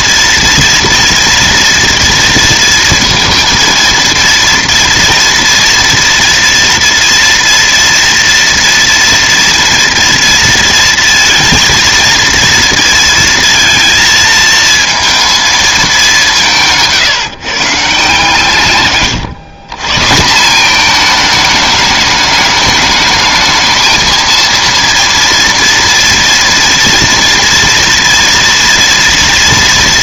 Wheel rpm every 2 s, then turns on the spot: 230, 230, 230, 230, 230, 230, 230, 230, 150, 130, 210, 210, 230, 230, 230.
18-20